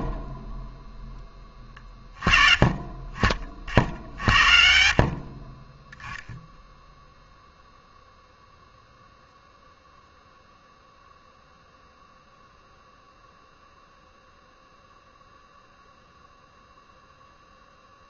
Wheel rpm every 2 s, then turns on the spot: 30, 0, 0, 0, 0, 0, 0, 0, 0.
none